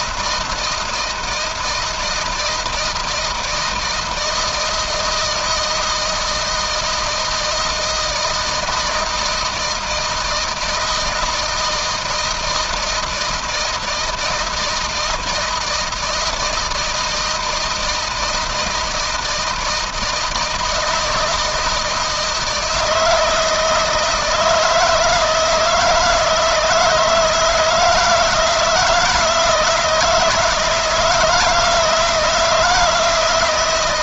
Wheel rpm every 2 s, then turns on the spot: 160, 160, 160, 160, 160, 160, 160, 160, 170, 160, 160, 160, 160, 160, 160, 160, 160.
none